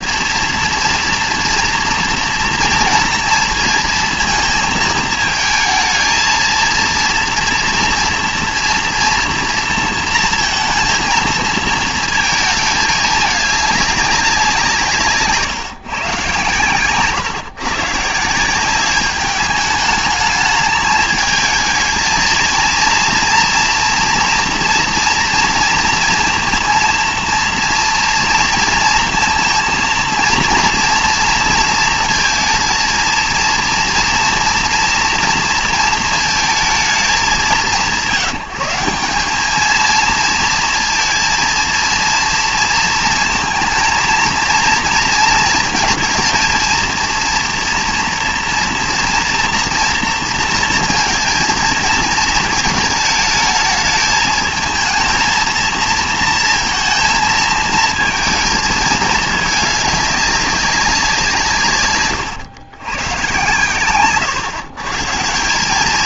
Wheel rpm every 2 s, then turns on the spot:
230, 230, 230, 230, 240, 230, 220, 170, 120, 200, 210, 230, 240, 230, 230, 230, 230, 230, 220, 180, 230, 230, 230, 230, 240, 230, 220, 220, 230, 220, 200, 120, 130.
none